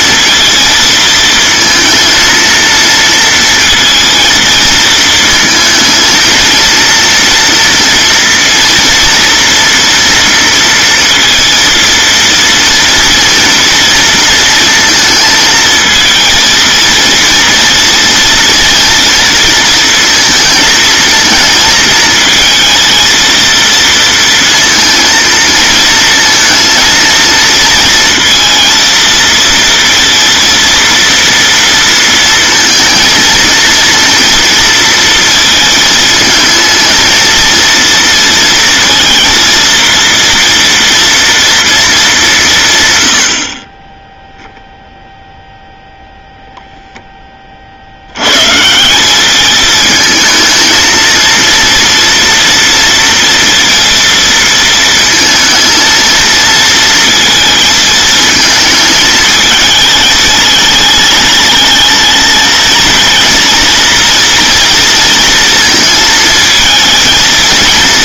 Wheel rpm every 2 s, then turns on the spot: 230, 230, 220, 230, 230, 230, 230, 230, 230, 230, 220, 220, 230, 230, 230, 230, 220, 230, 220, 230, 230, 150, 0, 0, 170, 220, 230, 230, 230, 220, 220, 230, 230, 220.
none